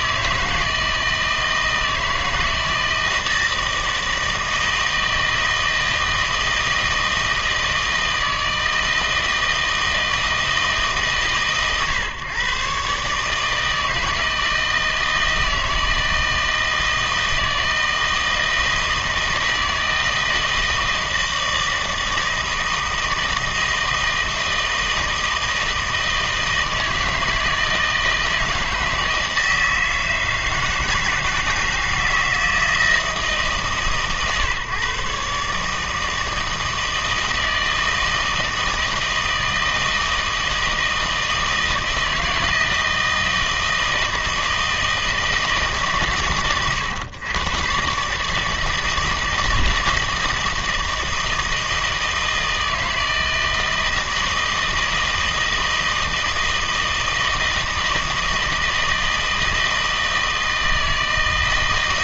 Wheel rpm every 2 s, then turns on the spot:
160, 160, 160, 160, 160, 150, 130, 160, 160, 160, 160, 160, 160, 160, 160, 160, 160, 130, 160, 160, 160, 160, 160, 110, 160, 160, 160, 160, 160, 160, 160.
none